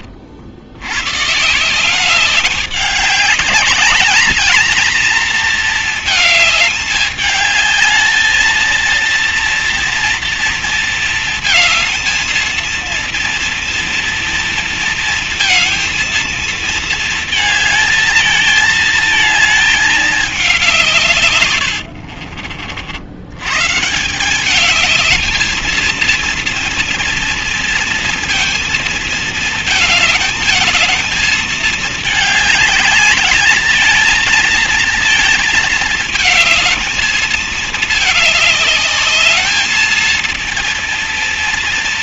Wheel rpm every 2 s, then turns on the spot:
50, 190, 210, 220, 220, 230, 230, 230, 230, 220, 210, 60, 180, 220, 230, 220, 210, 230, 220, 210, 220.
22-24